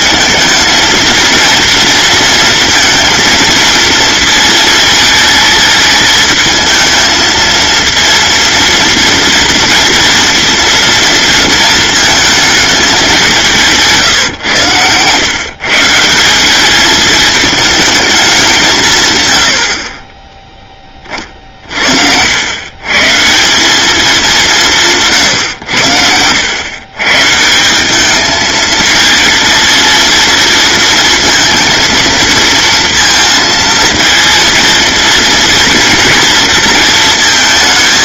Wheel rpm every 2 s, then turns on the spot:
220, 230, 230, 220, 230, 240, 210, 120, 190, 170, 20, 120, 180, 100, 220, 230, 230, 230, 230.
none